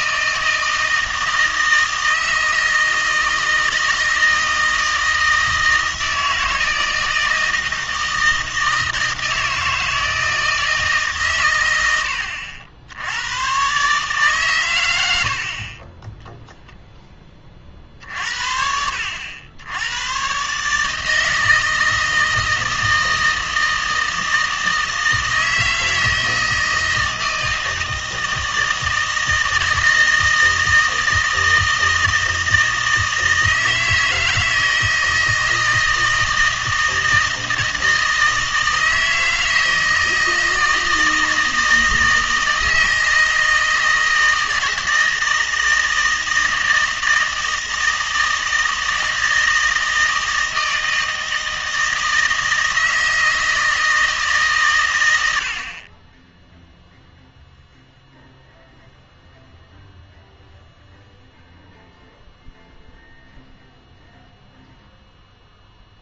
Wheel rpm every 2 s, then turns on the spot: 160, 160, 160, 160, 160, 160, 80, 120, 0, 60, 150, 160, 160, 160, 160, 160, 160, 160, 160, 160, 160, 160, 160, 160, 160, 160, 160, 130, 0, 0, 0, 0, 0.
none